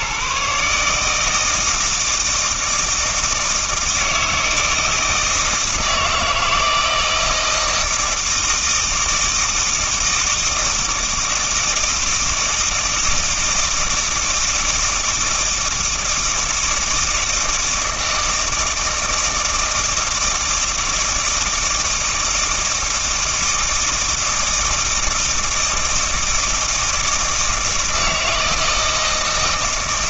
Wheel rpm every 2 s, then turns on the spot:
150, 160, 160, 160, 160, 160, 160, 160, 160, 160, 160, 160, 160, 160, 160.
none